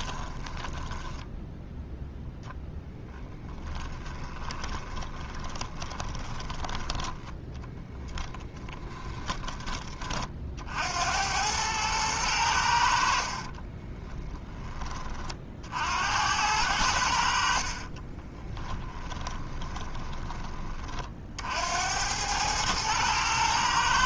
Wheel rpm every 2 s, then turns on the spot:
10, 0, 20, 10, 20, 70, 70, 30, 90, 10, 30, 110.
0-2 4-6 8-10 18-20